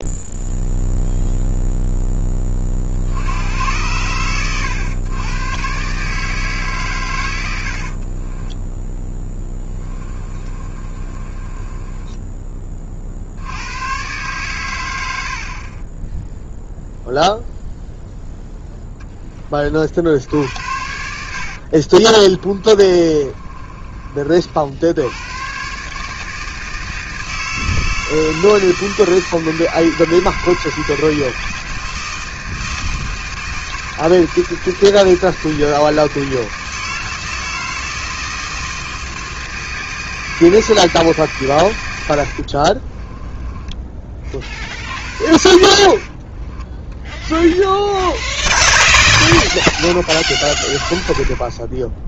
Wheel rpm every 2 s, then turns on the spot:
0, 30, 100, 140, 20, 30, 20, 110, 0, 0, 70, 30, 70, 160, 160, 160, 160, 160, 160, 160, 160, 50, 50, 30, 10, 30.
8-12 22-24 42-44 46-48